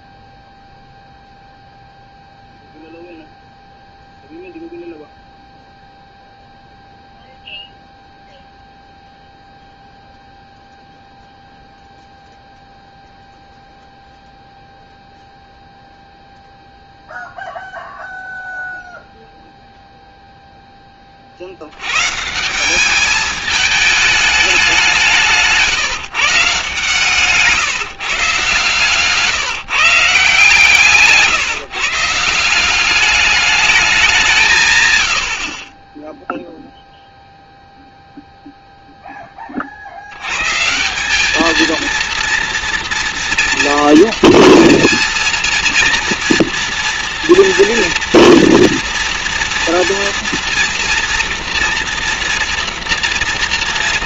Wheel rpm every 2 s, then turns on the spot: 0, 0, 0, 0, 0, 0, 0, 0, 0, 0, 10, 180, 200, 160, 150, 160, 180, 140, 0, 0, 150, 230, 230, 230, 230, 230, 240.
none